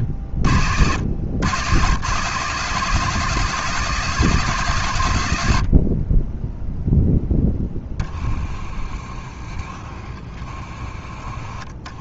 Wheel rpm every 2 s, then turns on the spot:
80, 160, 140, 10, 20, 20.
none